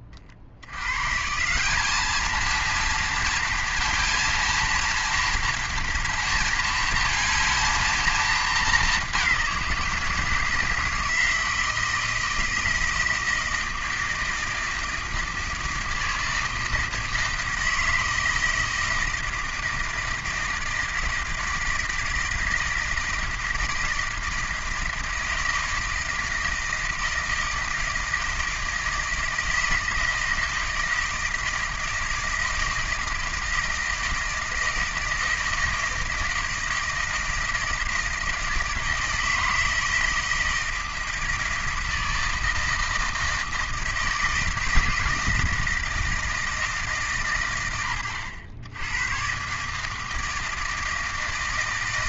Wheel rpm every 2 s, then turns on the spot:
80, 230, 230, 230, 220, 170, 160, 160, 160, 160, 160, 160, 160, 160, 160, 160, 160, 160, 160, 160, 160, 160, 160, 160, 90, 160.
none